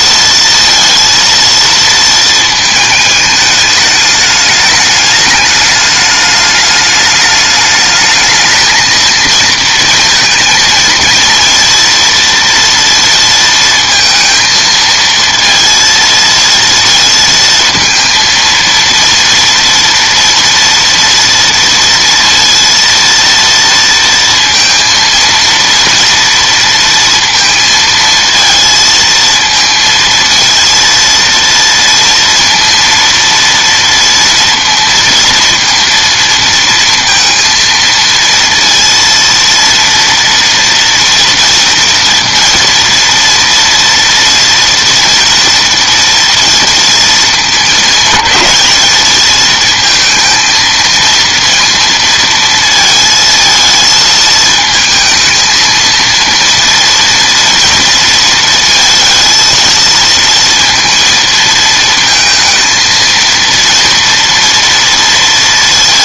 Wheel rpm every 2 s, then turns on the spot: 230, 220, 210, 210, 220, 230, 230, 230, 230, 230, 230, 230, 230, 230, 220, 230, 230, 230, 230, 230, 230, 230, 240, 230, 210, 230, 220, 220, 230, 230, 230, 220, 230.
none